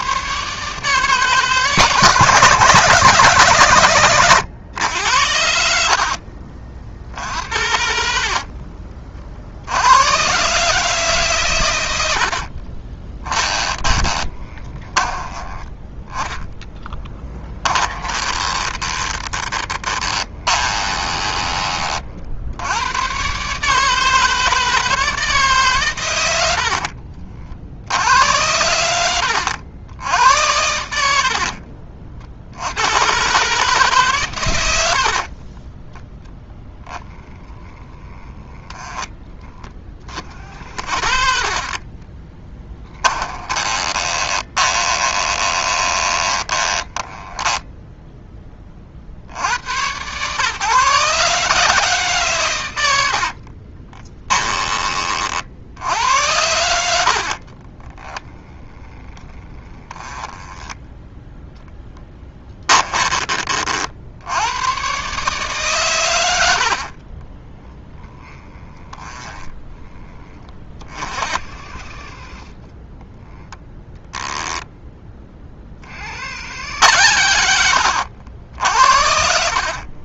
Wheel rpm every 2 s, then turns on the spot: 150, 160, 90, 50, 40, 140, 30, 20, 10, 20, 20, 100, 160, 50, 90, 70, 100, 80, 10, 10, 50, 10, 20, 20, 40, 140, 90, 30, 70, 10, 10, 20, 120, 50, 10, 40, 20, 10, 100, 70.
12-22 26-28 42-48 52-54 62-64 66-70 76-78